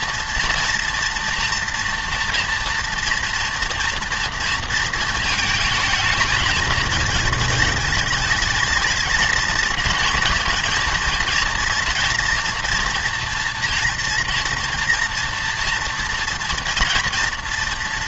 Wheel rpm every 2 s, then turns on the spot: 230, 230, 230, 220, 220, 230, 230, 230, 230.
none